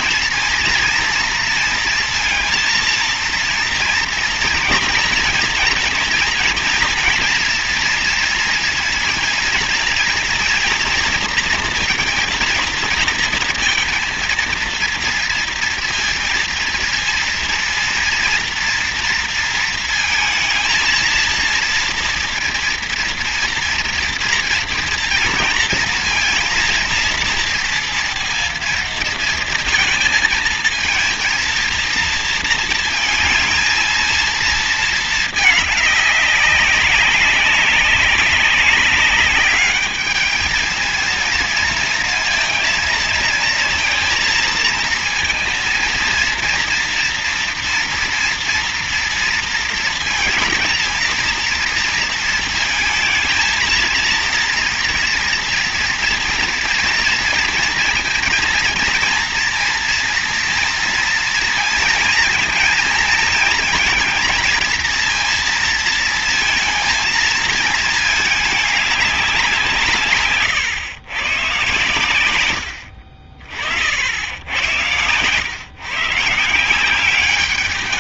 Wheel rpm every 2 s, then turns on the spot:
230, 230, 230, 240, 230, 230, 230, 230, 230, 230, 230, 230, 230, 230, 230, 220, 230, 220, 190, 200, 220, 230, 220, 230, 230, 220, 230, 230, 230, 230, 230, 230, 230, 230, 210, 120, 90, 100, 180.
none